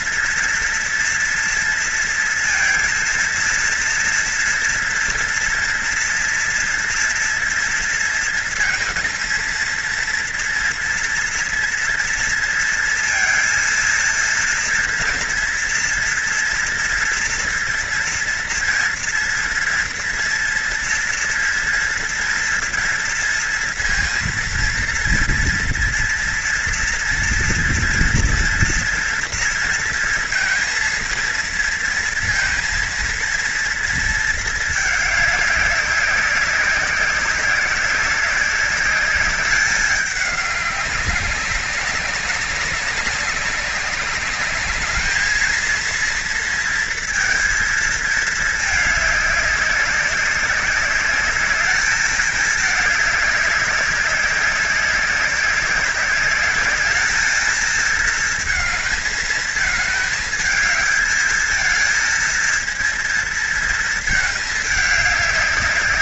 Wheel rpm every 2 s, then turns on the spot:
230, 230, 230, 230, 230, 230, 230, 230, 230, 230, 230, 230, 230, 230, 230, 230, 230, 210, 190, 200, 200, 200, 200, 230, 220, 190, 210, 200, 210, 230, 220, 230, 210.
none